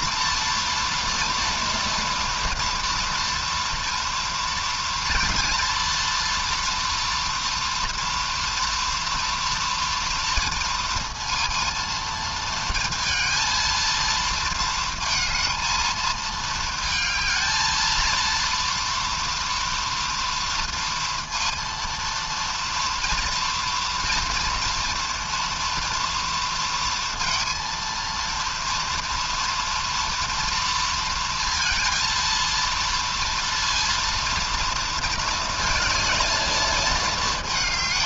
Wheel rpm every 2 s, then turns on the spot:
230, 230, 230, 230, 230, 230, 230, 230, 220, 230, 230, 230, 230, 230, 230, 230, 230, 230, 230.
none